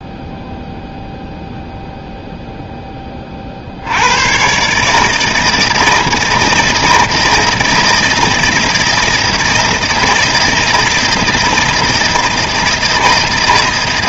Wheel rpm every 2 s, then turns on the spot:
0, 10, 140, 160, 160, 160, 160.
none